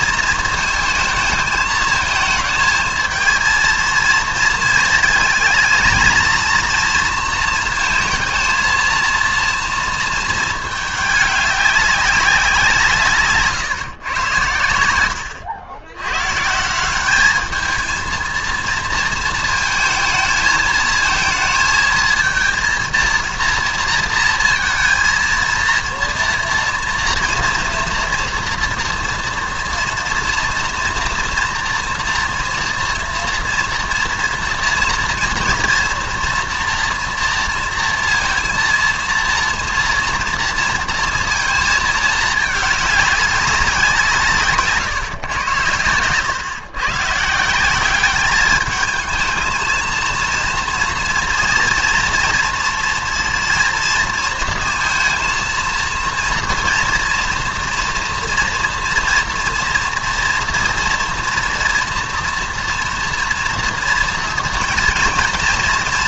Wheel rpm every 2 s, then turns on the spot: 230, 220, 230, 230, 230, 210, 170, 90, 180, 230, 220, 230, 230, 230, 230, 230, 240, 230, 230, 230, 230, 210, 140, 130, 210, 230, 230, 230, 230, 230, 230, 230, 230.
none